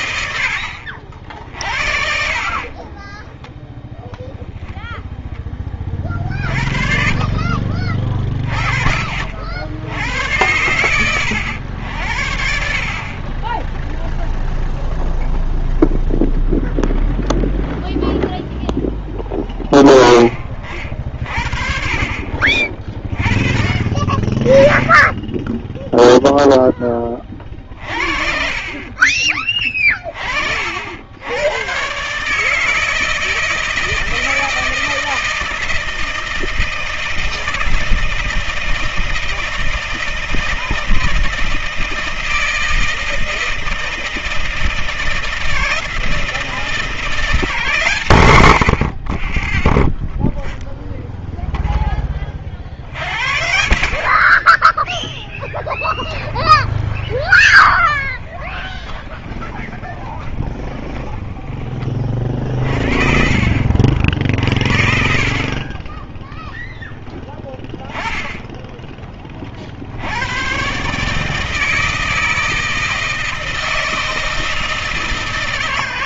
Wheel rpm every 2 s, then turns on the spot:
60, 30, 0, 40, 30, 90, 40, 0, 0, 0, 40, 30, 20, 10, 40, 60, 160, 160, 160, 160, 160, 160, 160, 170, 70, 0, 40, 10, 20, 10, 10, 30, 60, 0, 10, 130, 160, 160.
2-4 56-62